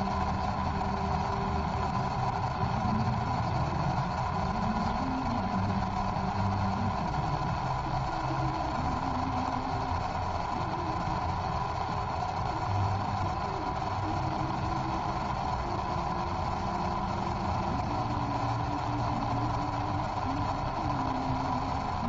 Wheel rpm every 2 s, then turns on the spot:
0, 0, 0, 0, 0, 0, 0, 0, 0, 0, 0.
none